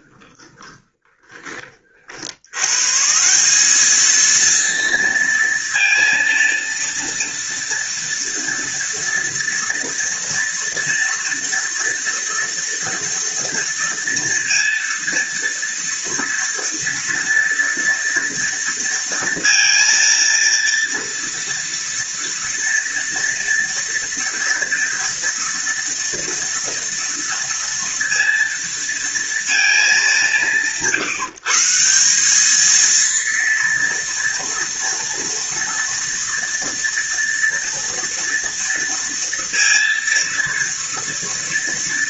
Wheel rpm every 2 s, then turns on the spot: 30, 110, 230, 230, 240, 230, 230, 230, 230, 230, 230, 230, 230, 230, 230, 140, 220, 230, 230, 230, 230.
0-2